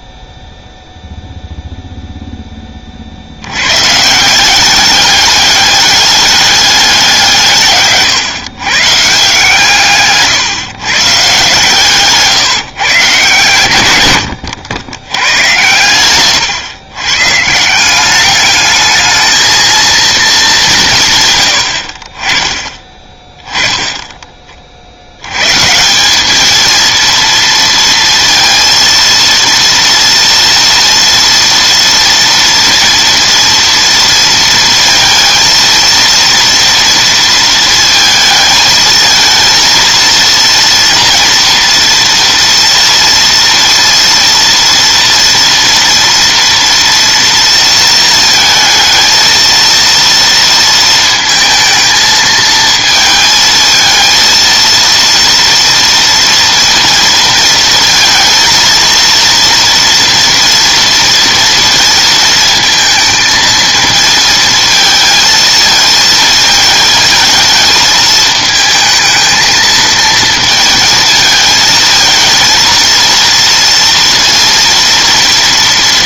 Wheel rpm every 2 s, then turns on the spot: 0, 30, 190, 200, 140, 120, 140, 100, 120, 210, 180, 20, 40, 220, 230, 230, 230, 230, 230, 220, 230, 230, 230, 230, 220, 230, 220, 230, 230, 220, 230, 230, 230, 220, 220, 220, 230, 230.
none